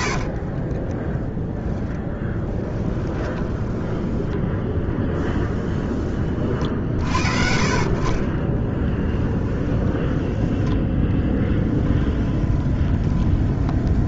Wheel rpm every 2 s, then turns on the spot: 30, 10, 10, 50, 20, 10, 20.
0-4 8-10 12-14